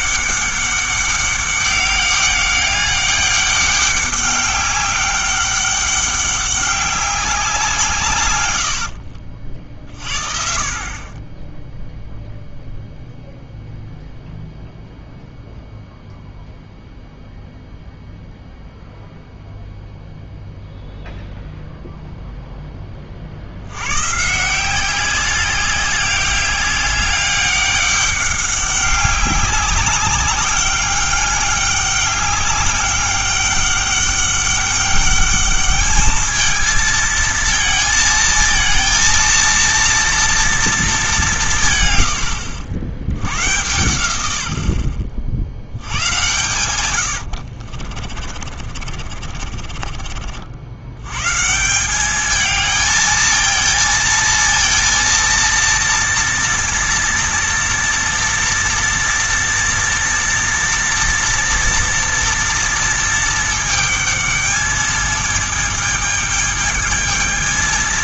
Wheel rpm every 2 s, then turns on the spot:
200, 200, 200, 200, 70, 40, 0, 0, 0, 0, 0, 10, 170, 200, 200, 200, 200, 200, 220, 230, 220, 70, 70, 110, 40, 80, 220, 230, 230, 230, 240, 230, 220, 220.
8-10 46-50